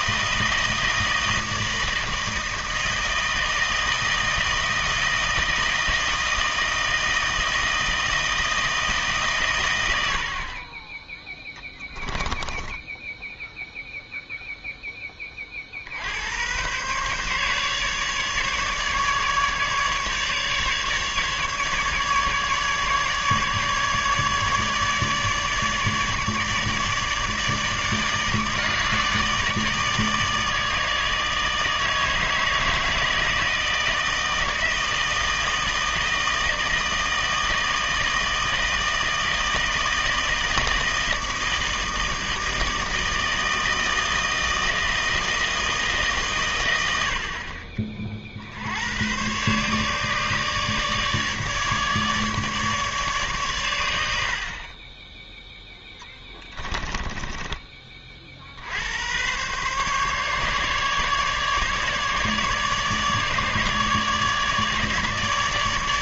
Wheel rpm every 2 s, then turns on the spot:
160, 160, 160, 160, 160, 50, 10, 0, 110, 150, 150, 150, 150, 150, 150, 160, 160, 160, 160, 160, 160, 160, 160, 120, 70, 150, 150, 40, 10, 60, 150, 150, 150.
10-14 56-58